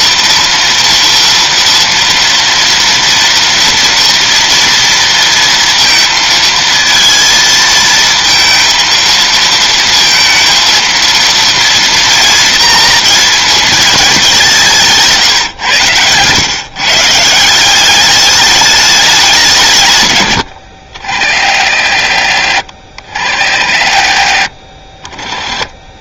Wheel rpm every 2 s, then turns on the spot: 230, 240, 230, 230, 230, 230, 230, 190, 130, 210, 90, 60, 40.
20-22